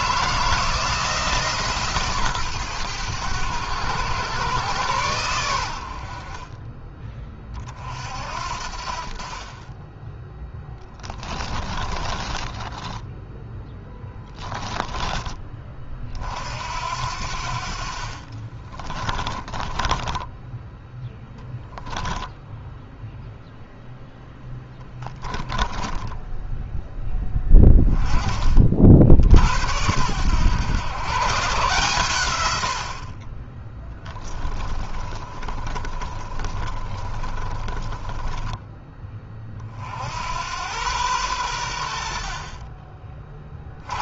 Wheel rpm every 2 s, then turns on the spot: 160, 120, 110, 30, 50, 10, 10, 10, 60, 30, 10, 0, 10, 10, 40, 110, 90, 20, 30, 20, 100, 40.
10-14 18-22 24-26 34-38